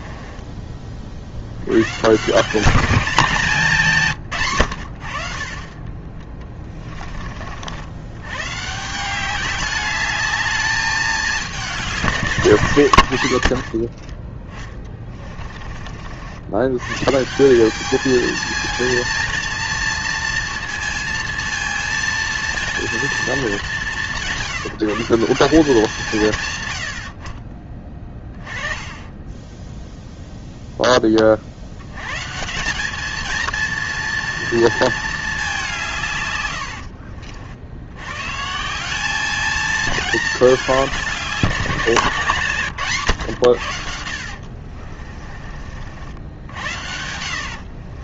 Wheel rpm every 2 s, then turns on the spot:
20, 190, 100, 20, 140, 210, 130, 20, 110, 220, 220, 230, 160, 100, 20, 10, 190, 230, 80, 160, 200, 140, 50, 80.
6-8 12-16 36-38 44-46